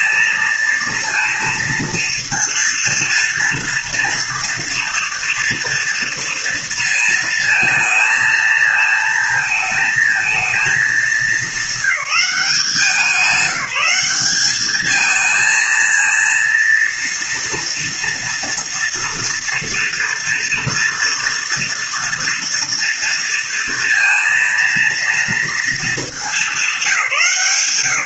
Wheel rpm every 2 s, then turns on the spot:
230, 230, 230, 230, 220, 220, 190, 210, 230, 240, 230, 230, 230, 200.
none